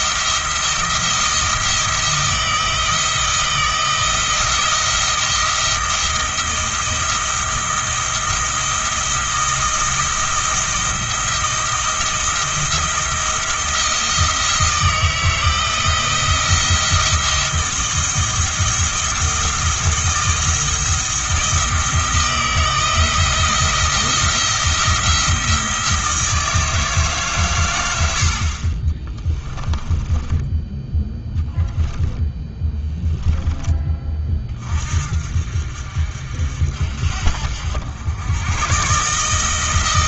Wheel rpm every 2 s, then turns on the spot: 170, 160, 170, 170, 170, 170, 170, 170, 170, 170, 170, 170, 170, 160, 30, 10, 10, 50, 60, 130.
32-34